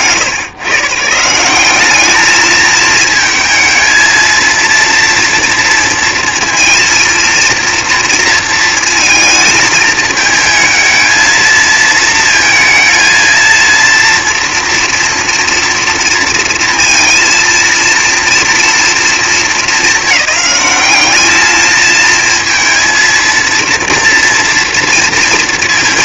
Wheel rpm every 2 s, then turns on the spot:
210, 230, 230, 230, 220, 220, 230, 230, 230, 190, 220, 230, 230.
none